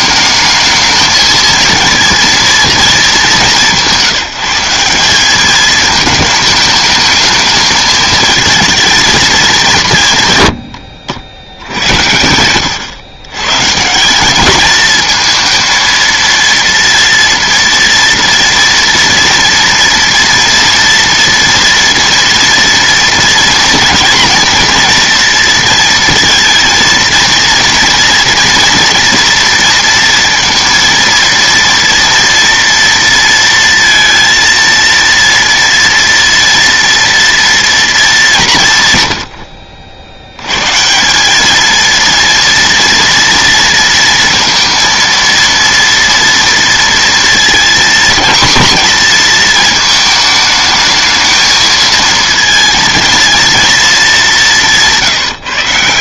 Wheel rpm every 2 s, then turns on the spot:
220, 220, 180, 210, 220, 90, 100, 210, 230, 230, 230, 230, 230, 230, 230, 230, 230, 230, 230, 140, 120, 230, 230, 230, 230, 220, 230, 190.
none